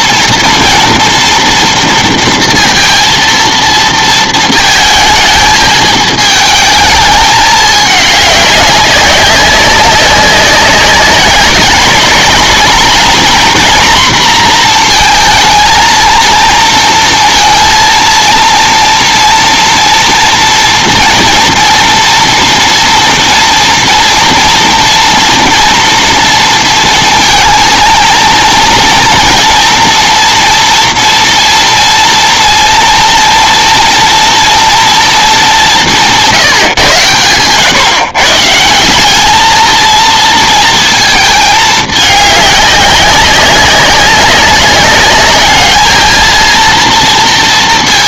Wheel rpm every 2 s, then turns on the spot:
230, 230, 220, 220, 200, 200, 220, 230, 230, 230, 240, 240, 230, 230, 230, 230, 230, 230, 160, 150, 230, 200, 190, 230.
none